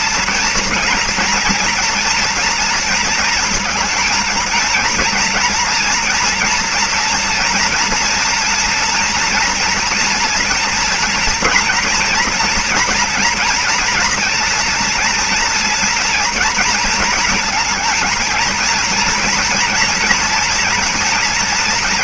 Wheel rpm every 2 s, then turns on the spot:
230, 230, 220, 230, 230, 230, 230, 230, 230, 230, 230.
none